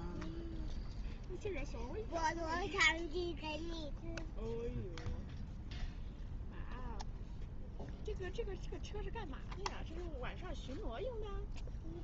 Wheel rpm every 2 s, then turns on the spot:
0, 0, 0, 0, 0, 0.
none